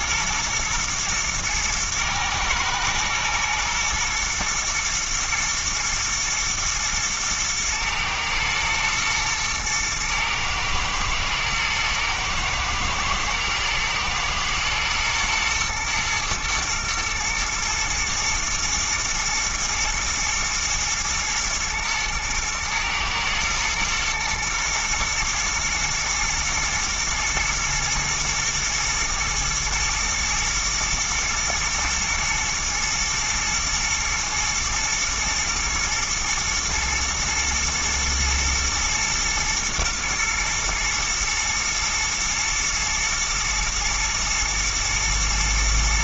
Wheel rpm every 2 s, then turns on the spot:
110, 110, 120, 110, 110, 120, 110, 120, 120, 120, 110, 110, 110, 120, 110, 110, 110, 110, 110, 110, 110, 110, 110.
none